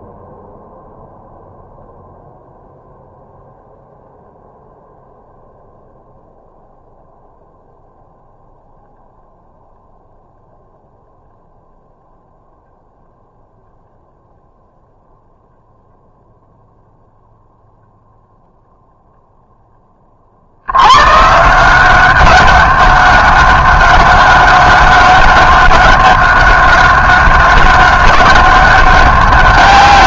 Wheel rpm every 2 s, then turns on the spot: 0, 0, 0, 0, 0, 0, 0, 0, 0, 0, 80, 190, 190, 190, 200.
none